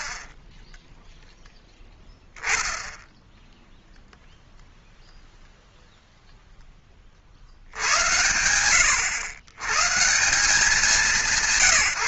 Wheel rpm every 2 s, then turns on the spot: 0, 0, 0, 60, 110, 180.
none